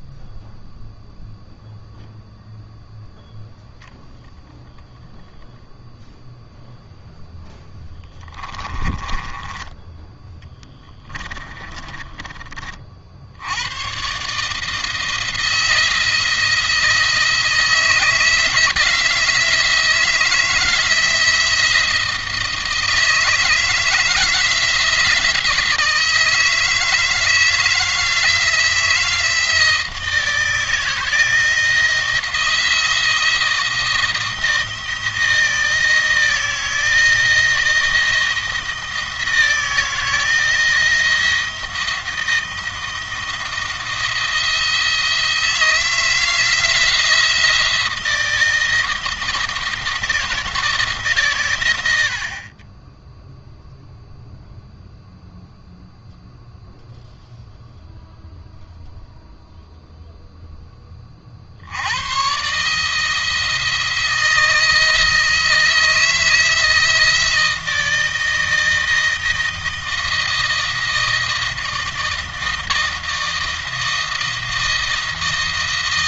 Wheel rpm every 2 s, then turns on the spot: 0, 0, 0, 0, 20, 10, 40, 160, 160, 170, 160, 160, 170, 160, 170, 160, 170, 160, 160, 170, 160, 170, 160, 160, 160, 150, 20, 0, 0, 0, 20, 150, 160, 160, 160, 160, 160, 160.
8-12